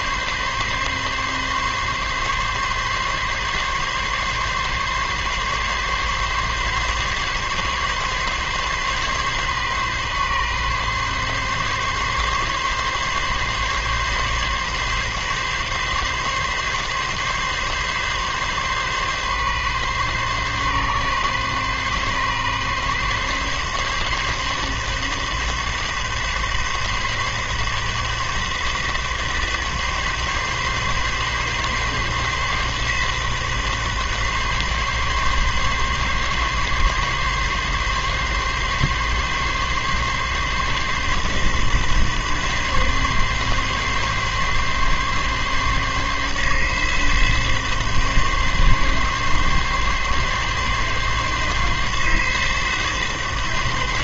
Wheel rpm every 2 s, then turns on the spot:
140, 140, 140, 140, 140, 140, 140, 130, 140, 140, 140, 140, 140, 140, 140, 140, 140, 130, 140, 140, 140, 140, 140, 140, 140, 140, 140.
none